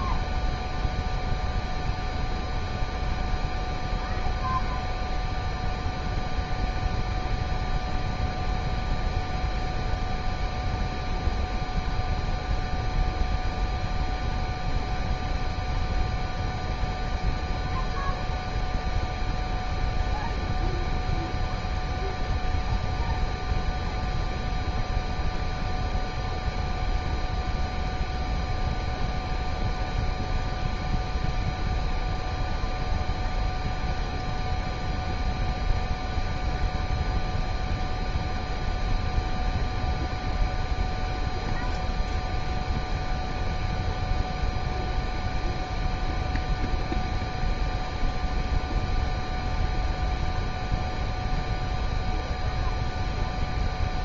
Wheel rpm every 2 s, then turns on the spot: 0, 0, 0, 0, 0, 0, 0, 0, 0, 0, 0, 0, 0, 0, 0, 0, 0, 0, 0, 0, 0, 0, 0, 0, 0, 0, 0.
none